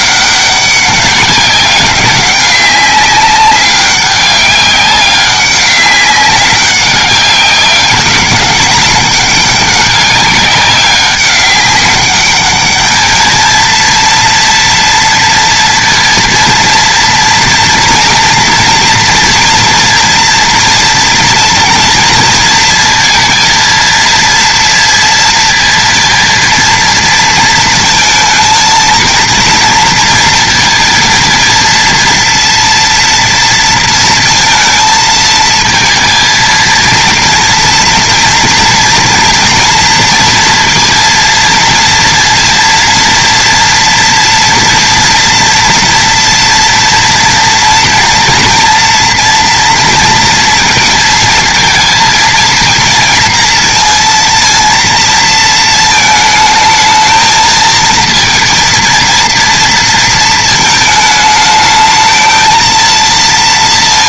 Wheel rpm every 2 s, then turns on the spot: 200, 190, 200, 190, 200, 200, 210, 230, 230, 240, 230, 230, 230, 230, 220, 230, 230, 220, 230, 230, 230, 230, 230, 230, 230, 230, 230, 230, 220, 230, 220, 230.
none